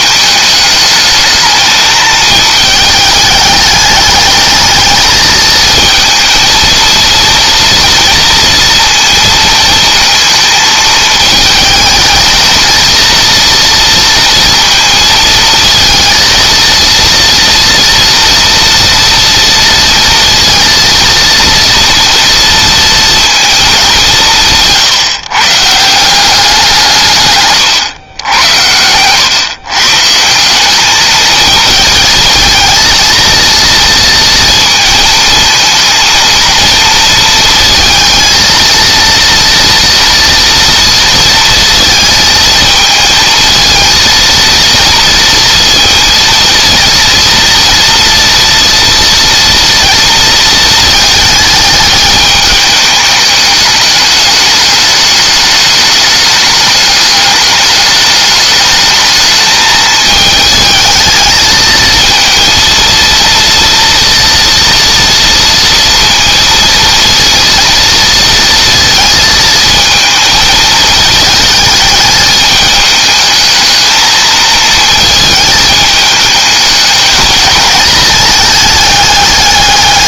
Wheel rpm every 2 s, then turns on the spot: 210, 210, 220, 230, 230, 220, 230, 230, 230, 230, 230, 230, 150, 150, 110, 210, 230, 230, 230, 230, 230, 220, 230, 230, 230, 220, 210, 210, 210, 210, 220, 230, 230, 230, 230, 220, 210, 220, 210, 190.
none